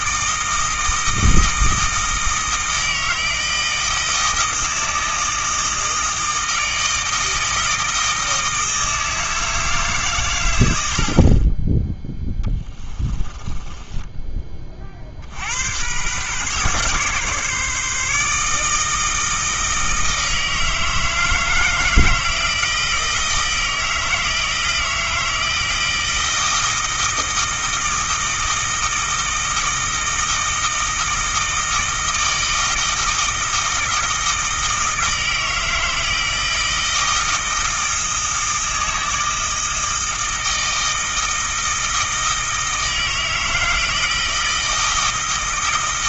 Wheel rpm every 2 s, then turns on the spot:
160, 160, 160, 160, 160, 70, 20, 40, 140, 160, 160, 160, 160, 160, 160, 160, 160, 160, 160, 160, 160, 160, 160.
12-14